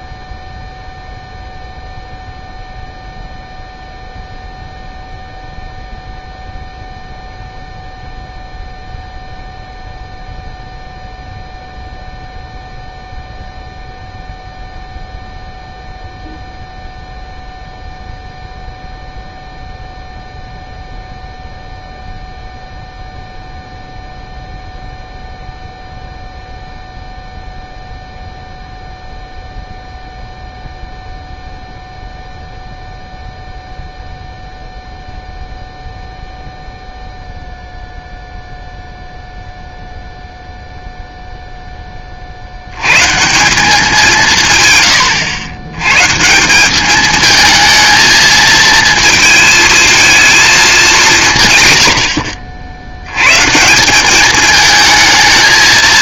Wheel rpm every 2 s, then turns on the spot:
0, 0, 0, 0, 0, 0, 0, 0, 0, 0, 0, 0, 0, 0, 0, 0, 0, 0, 0, 0, 0, 90, 140, 190, 220, 210, 80, 220.
none